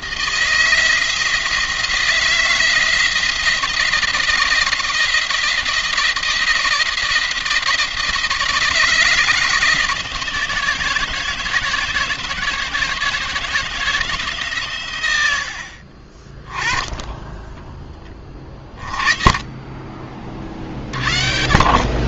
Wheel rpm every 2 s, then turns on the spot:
160, 170, 170, 170, 160, 160, 160, 120, 10, 20, 50.
none